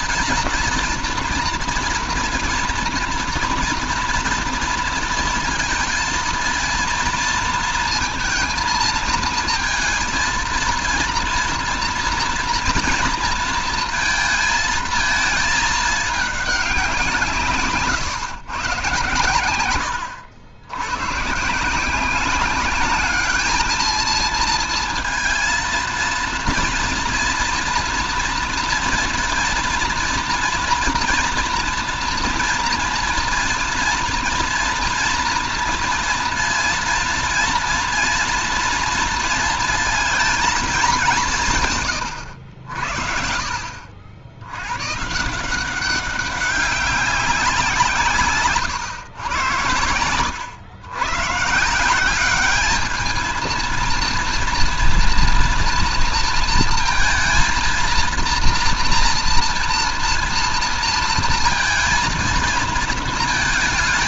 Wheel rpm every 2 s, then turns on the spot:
230, 230, 230, 230, 230, 230, 230, 230, 200, 130, 90, 200, 230, 230, 230, 230, 230, 230, 230, 230, 210, 90, 110, 200, 130, 100, 210, 230, 230, 230, 230, 220.
none